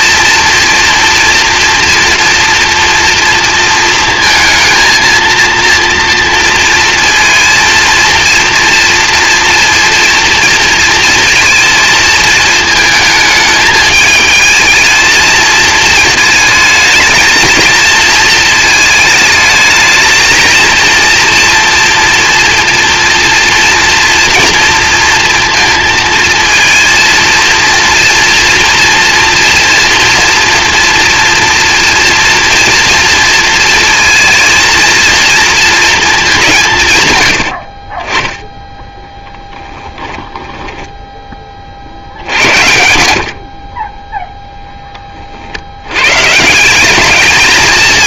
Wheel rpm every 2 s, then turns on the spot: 230, 230, 230, 230, 230, 230, 220, 220, 220, 220, 230, 230, 230, 230, 230, 230, 230, 230, 180, 10, 10, 80, 0, 160.
40-42